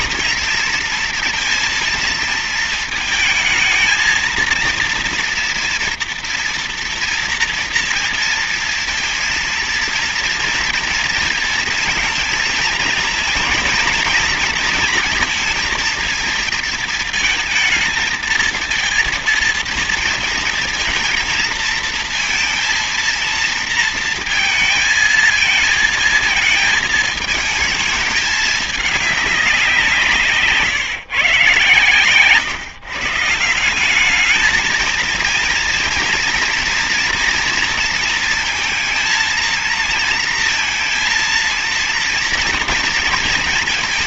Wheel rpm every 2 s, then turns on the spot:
230, 230, 230, 230, 230, 230, 230, 230, 230, 230, 230, 230, 220, 220, 210, 150, 130, 220, 230, 230, 230, 230.
none